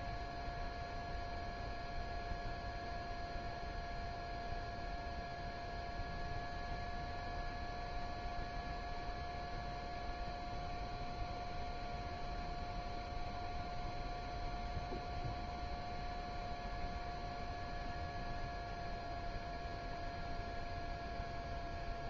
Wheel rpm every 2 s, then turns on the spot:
0, 0, 0, 0, 0, 0, 0, 0, 0, 0, 0.
none